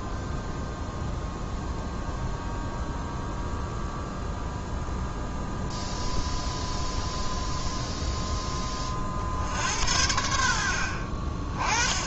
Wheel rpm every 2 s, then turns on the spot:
0, 0, 0, 0, 30, 60.
none